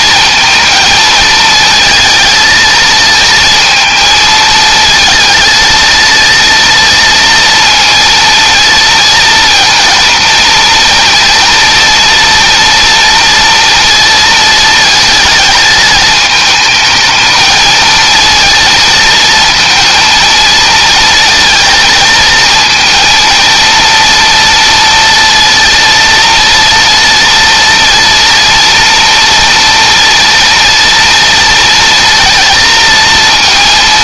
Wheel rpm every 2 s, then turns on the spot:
230, 220, 220, 230, 230, 230, 230, 230, 210, 230, 230, 230, 230, 230, 230, 230, 230.
none